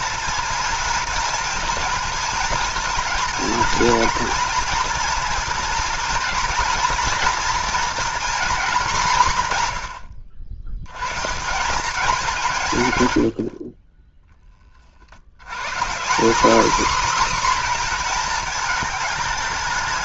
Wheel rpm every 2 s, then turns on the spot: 230, 230, 230, 240, 220, 100, 150, 30, 250, 220.
none